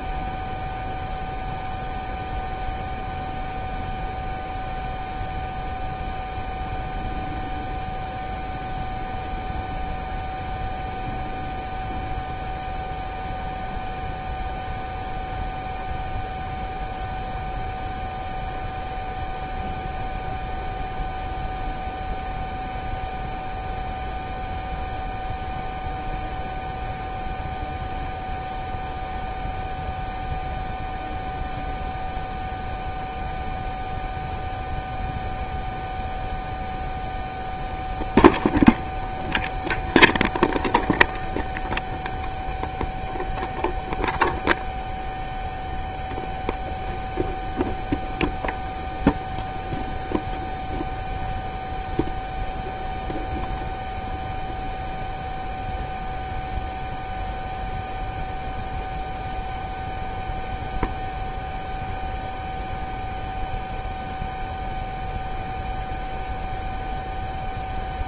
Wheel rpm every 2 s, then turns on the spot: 0, 0, 0, 0, 0, 0, 0, 0, 0, 0, 0, 0, 0, 0, 0, 0, 0, 0, 0, 0, 0, 0, 0, 0, 0, 0, 0, 0, 0, 0, 0, 0, 0, 0.
none